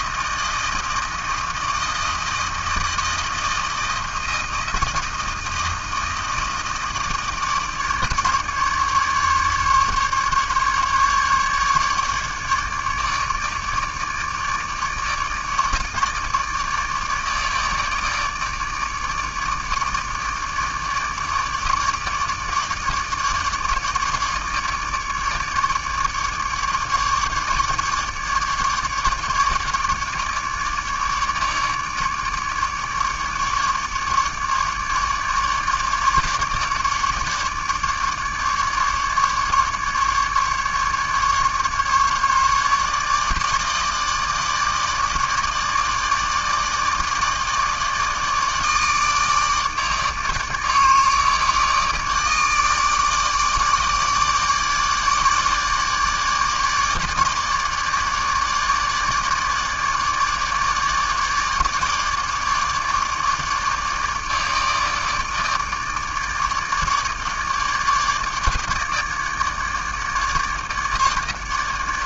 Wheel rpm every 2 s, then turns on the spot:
160, 160, 160, 160, 150, 150, 150, 150, 150, 150, 150, 150, 150, 150, 150, 150, 150, 150, 150, 150, 150, 150, 150, 160, 150, 150, 150, 150, 150, 150, 150, 150, 150, 150, 150, 150.
none